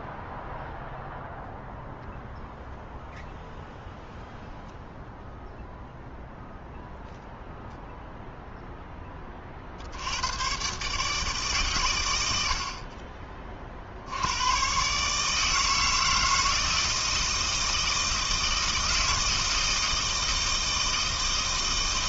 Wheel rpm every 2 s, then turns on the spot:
0, 0, 0, 0, 0, 120, 60, 120, 160, 160, 160.
none